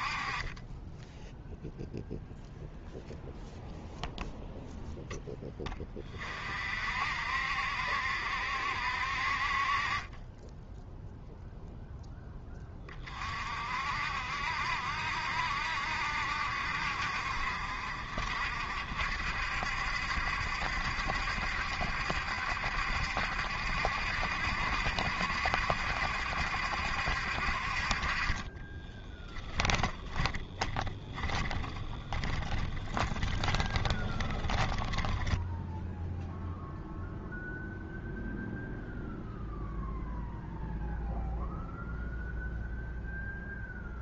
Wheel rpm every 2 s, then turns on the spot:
20, 0, 0, 50, 60, 10, 20, 60, 60, 60, 70, 70, 70, 70, 20, 20, 20, 20, 0, 0, 0, 0.
28-36